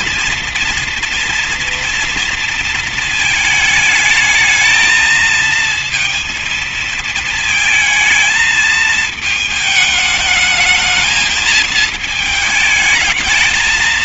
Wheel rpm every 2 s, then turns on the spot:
230, 230, 220, 220, 220, 210, 220.
none